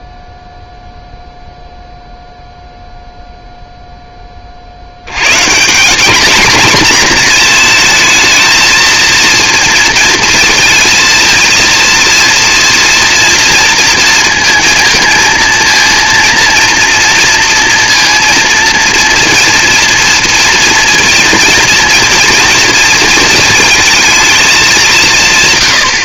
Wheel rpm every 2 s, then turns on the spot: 0, 0, 50, 230, 220, 230, 230, 230, 230, 230, 230, 230, 210.
none